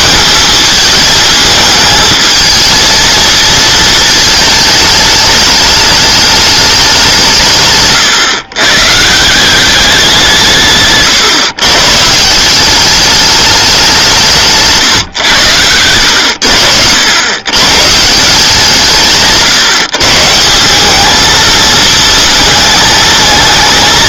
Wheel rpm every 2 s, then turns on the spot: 210, 220, 210, 200, 140, 140, 190, 150, 90, 160, 190, 220.
10-12